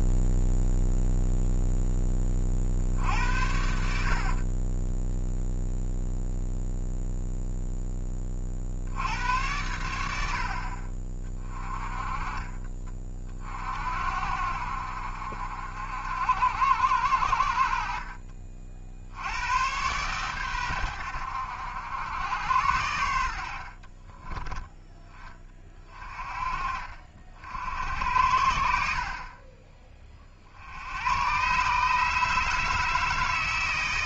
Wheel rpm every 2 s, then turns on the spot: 0, 50, 20, 0, 60, 50, 30, 70, 80, 50, 100, 90, 10, 40, 60, 80, 160.
4-6